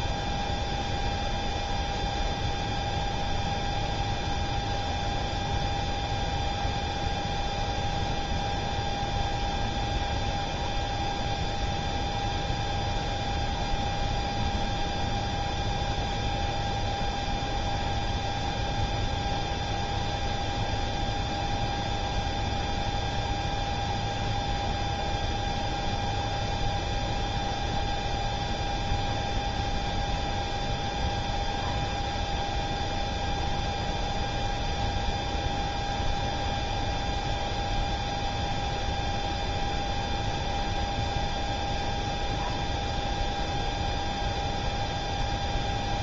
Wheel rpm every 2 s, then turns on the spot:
0, 0, 0, 0, 0, 0, 0, 0, 0, 0, 0, 0, 0, 0, 0, 0, 0, 0, 0, 0, 0, 0, 0.
none